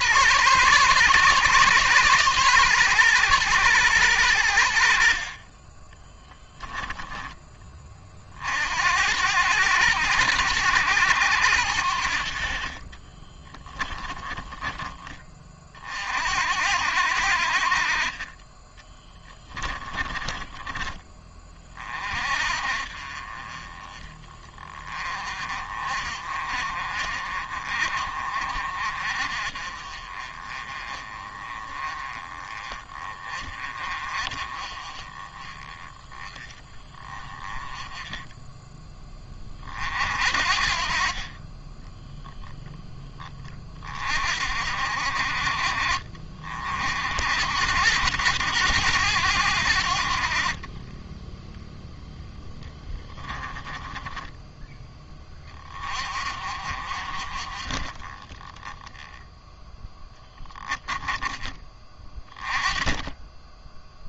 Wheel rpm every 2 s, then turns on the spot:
120, 120, 80, 10, 60, 90, 40, 30, 70, 20, 30, 40, 30, 40, 40, 30, 30, 30, 20, 20, 40, 10, 50, 60, 100, 20, 10, 10, 40, 10, 0, 20.
12-14 18-20 50-54